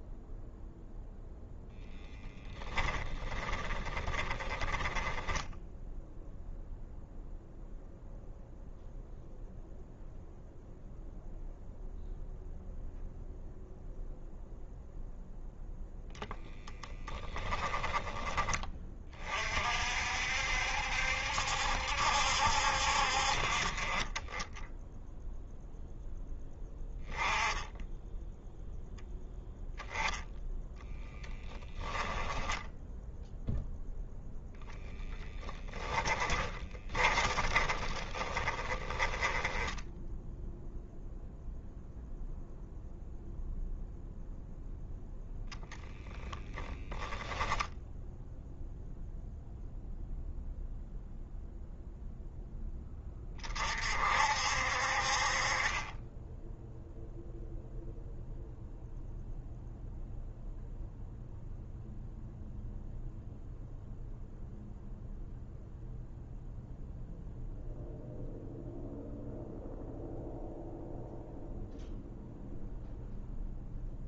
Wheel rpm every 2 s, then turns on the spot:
0, 20, 10, 0, 0, 0, 0, 0, 10, 30, 70, 50, 0, 10, 0, 10, 0, 0, 30, 10, 0, 0, 20, 10, 0, 0, 20, 50, 0, 0, 0, 0, 0, 0, 0, 0, 0.
2-6 30-32 36-40